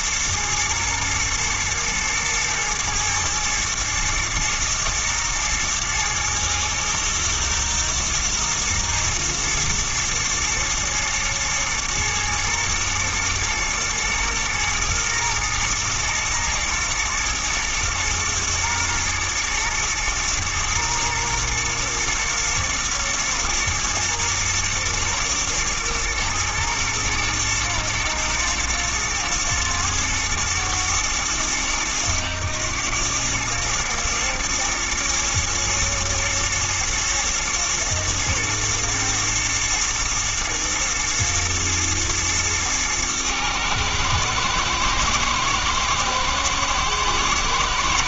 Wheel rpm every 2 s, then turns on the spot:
120, 120, 110, 110, 120, 120, 120, 110, 120, 120, 120, 120, 120, 120, 120, 110, 100, 120, 120, 110, 110, 110, 110, 110.
none